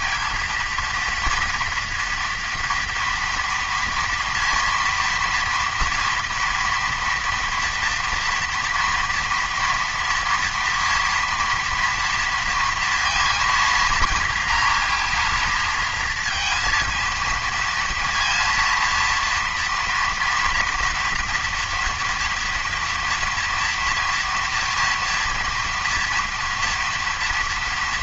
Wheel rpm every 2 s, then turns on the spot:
230, 230, 230, 230, 230, 230, 230, 230, 230, 230, 230, 230, 230, 240.
none